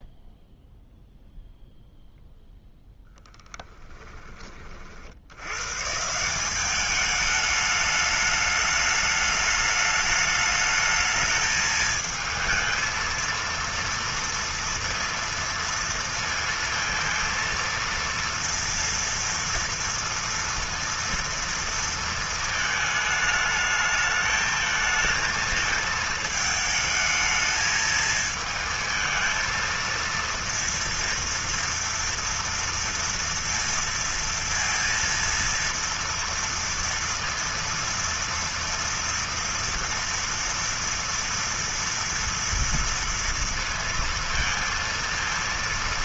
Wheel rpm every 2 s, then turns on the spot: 0, 0, 50, 200, 210, 220, 220, 230, 230, 230, 230, 220, 220, 220, 220, 230, 230, 230, 230, 230, 230, 230, 230.
none